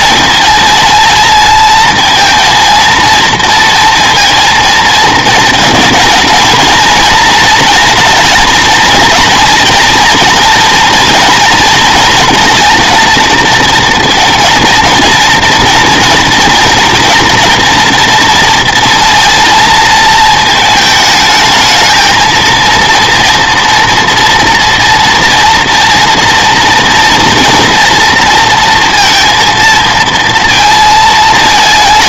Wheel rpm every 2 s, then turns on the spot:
230, 230, 230, 230, 230, 230, 230, 230, 230, 230, 220, 230, 230, 230, 230, 230.
none